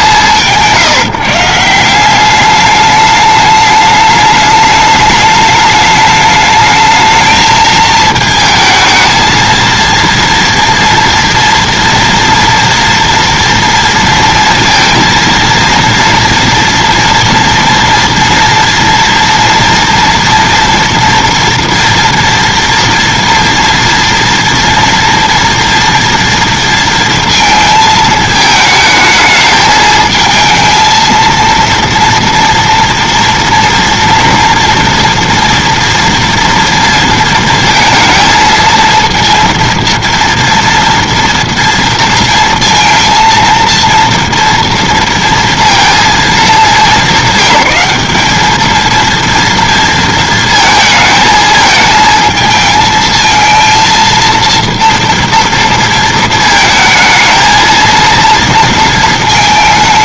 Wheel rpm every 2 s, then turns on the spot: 170, 200, 210, 210, 220, 230, 230, 230, 240, 230, 230, 230, 240, 230, 220, 220, 230, 230, 230, 220, 230, 230, 230, 210, 210, 230, 220, 230, 220, 230.
none